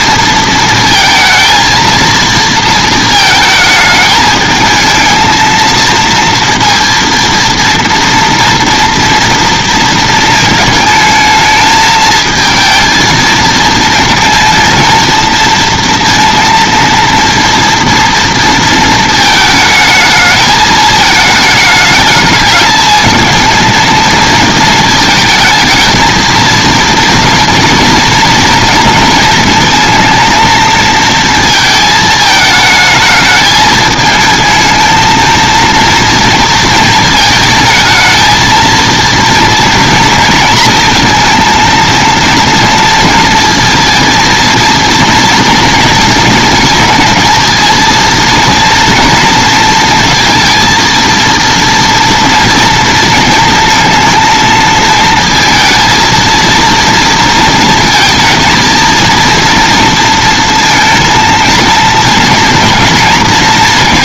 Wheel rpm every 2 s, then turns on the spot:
230, 230, 220, 230, 230, 220, 220, 230, 230, 230, 220, 210, 220, 220, 220, 230, 220, 220, 230, 230, 230, 230, 230, 230, 230, 230, 230, 220, 230, 230, 230, 230.
none